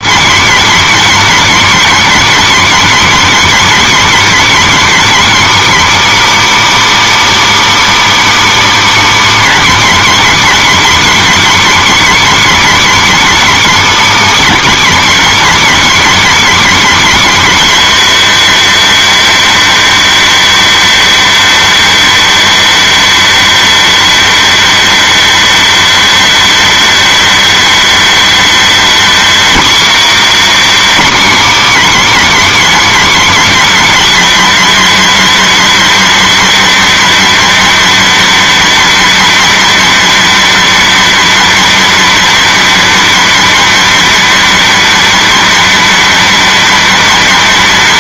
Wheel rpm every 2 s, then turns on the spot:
290, 290, 290, 310, 300, 280, 290, 290, 280, 290, 290, 280, 280, 280, 280, 300, 280, 280, 280, 280, 280, 280, 290, 280.
none